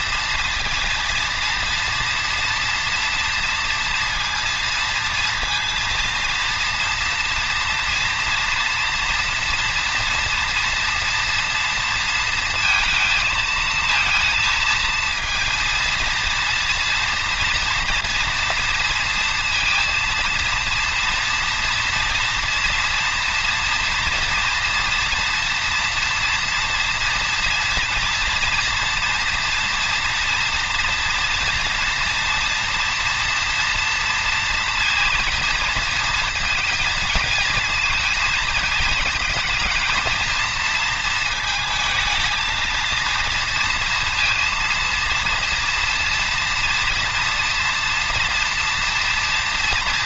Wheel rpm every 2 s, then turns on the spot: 230, 240, 230, 230, 230, 230, 230, 230, 230, 230, 230, 230, 240, 230, 230, 240, 240, 230, 230, 220, 220, 220, 230, 230, 230.
none